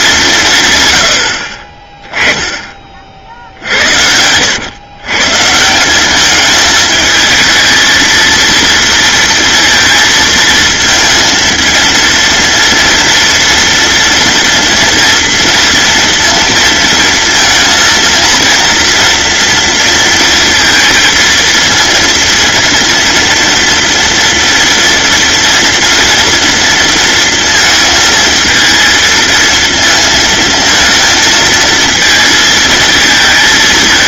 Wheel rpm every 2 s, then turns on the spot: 90, 60, 150, 220, 230, 230, 230, 230, 230, 230, 230, 230, 230, 230, 230, 230, 220.
none